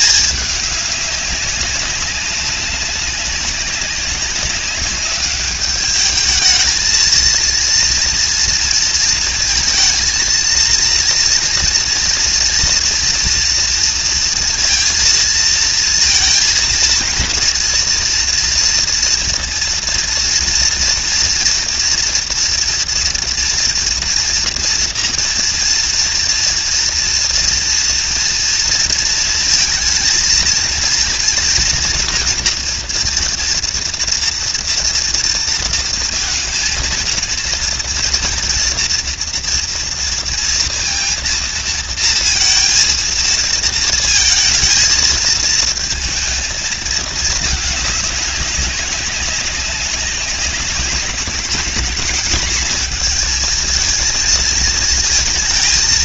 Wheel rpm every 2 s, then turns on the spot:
200, 190, 200, 220, 230, 240, 230, 230, 230, 230, 230, 230, 230, 230, 230, 230, 230, 230, 230, 230, 230, 230, 220, 220, 190, 190, 230, 220.
none